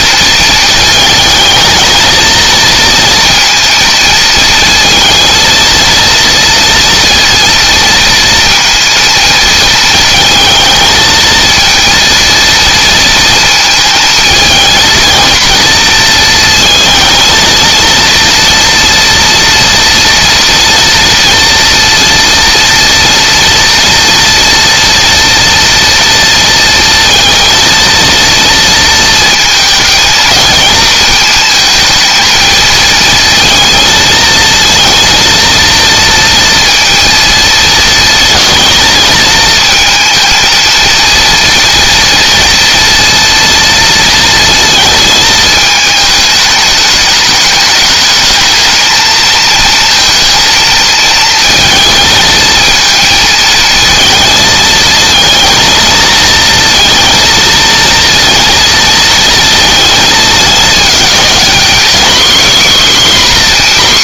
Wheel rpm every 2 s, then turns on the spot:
220, 230, 230, 230, 230, 220, 230, 230, 230, 230, 240, 230, 230, 230, 230, 220, 220, 230, 230, 230, 230, 230, 230, 210, 220, 230, 220, 220, 230, 230, 210, 260.
none